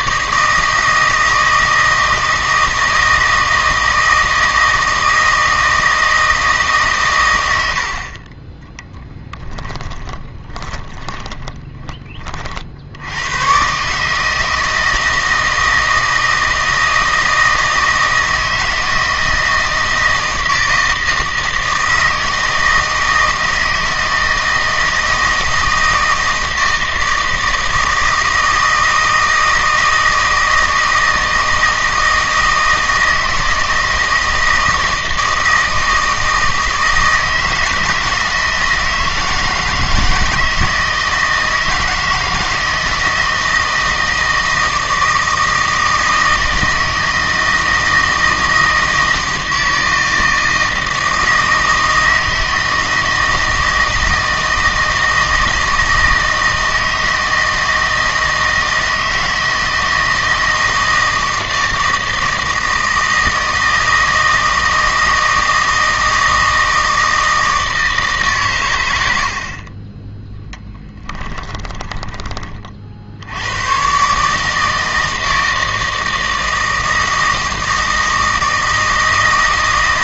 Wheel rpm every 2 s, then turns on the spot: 160, 160, 160, 150, 10, 20, 60, 160, 160, 160, 160, 160, 160, 160, 160, 160, 160, 160, 160, 170, 160, 160, 160, 160, 160, 160, 160, 160, 160, 160, 160, 160, 160, 160, 110, 20, 40, 160, 160, 160.
10-12 70-72